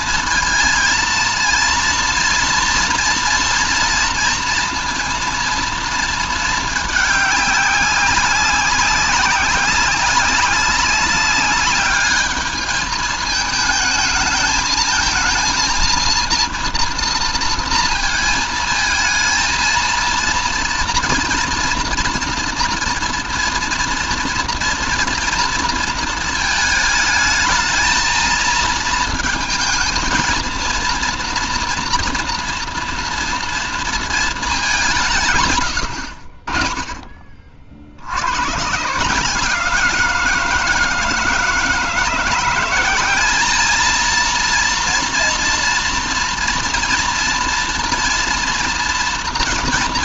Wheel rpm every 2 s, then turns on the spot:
230, 230, 230, 210, 190, 200, 210, 220, 230, 230, 230, 230, 230, 220, 220, 230, 230, 200, 40, 140, 160, 180, 230, 240, 230.
none